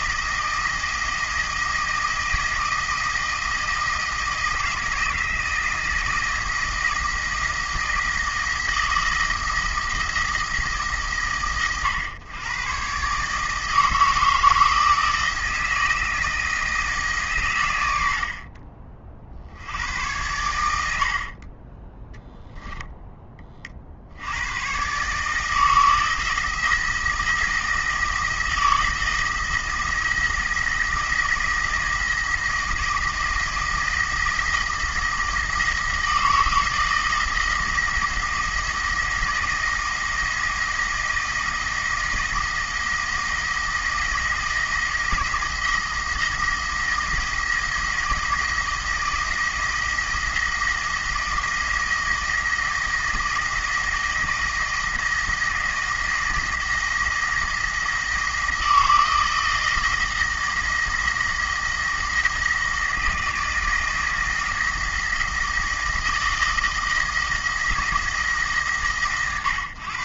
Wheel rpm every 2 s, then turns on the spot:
160, 160, 170, 170, 160, 160, 130, 160, 160, 50, 90, 0, 120, 170, 170, 160, 160, 160, 160, 170, 160, 160, 170, 170, 170, 160, 170, 160, 160, 160, 160, 160, 160, 160, 140.
20-22